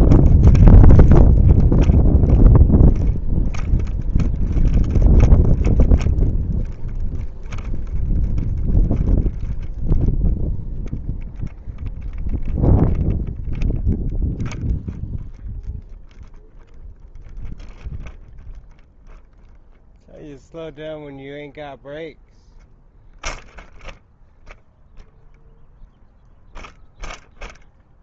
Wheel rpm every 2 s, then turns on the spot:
0, 0, 0, 0, 0, 0, 0, 0, 0, 0, 0, 0, 0, 0.
none